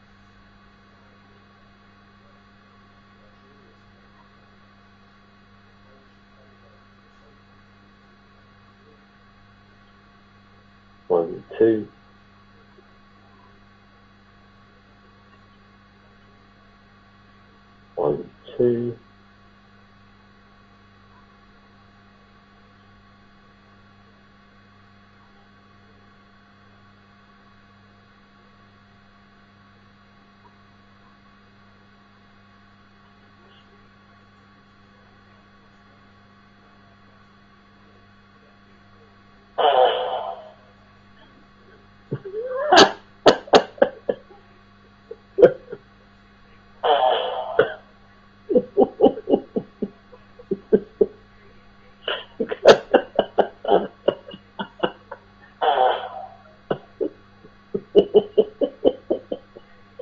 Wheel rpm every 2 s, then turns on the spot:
0, 0, 0, 0, 0, 0, 0, 0, 0, 0, 0, 0, 0, 0, 0, 0, 0, 0, 0, 0, 0, 0, 0, 0, 0, 0, 0, 0, 0, 0.
none